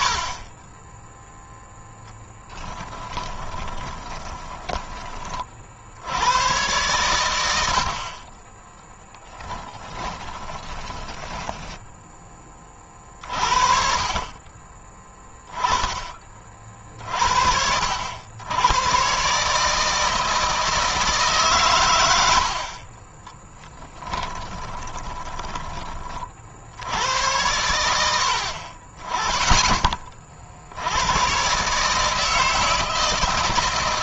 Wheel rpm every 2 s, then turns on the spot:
20, 20, 20, 110, 10, 20, 30, 20, 50, 120, 150, 30, 20, 80, 30, 90, 160.
2-4 8-12 22-26